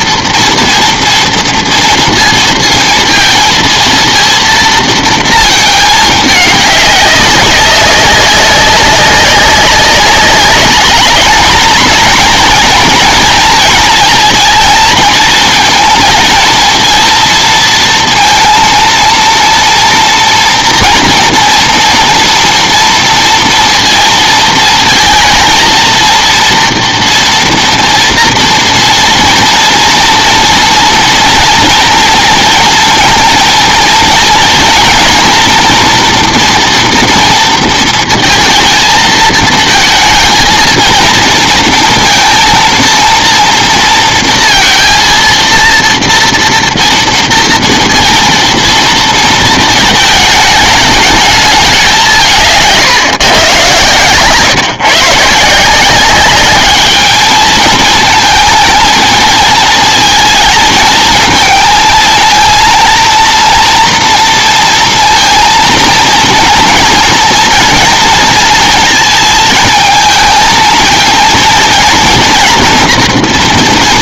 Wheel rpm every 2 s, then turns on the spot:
230, 220, 220, 200, 190, 210, 230, 220, 230, 230, 240, 230, 220, 230, 230, 240, 230, 230, 240, 230, 220, 230, 230, 230, 230, 210, 150, 140, 210, 230, 220, 230, 230, 230, 230, 220, 240.
none